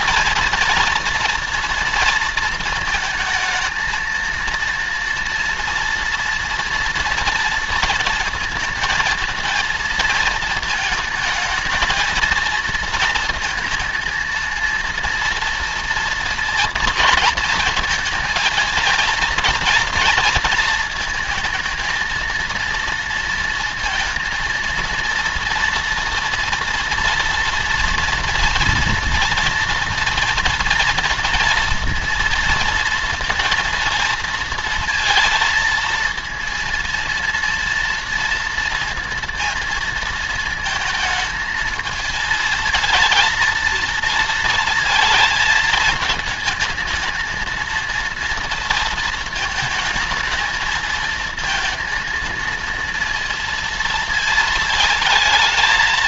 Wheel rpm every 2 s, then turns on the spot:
230, 230, 230, 230, 230, 220, 230, 230, 230, 220, 230, 230, 230, 230, 230, 230, 230, 230, 230, 230, 220, 220, 230, 220, 230, 220, 230, 220.
none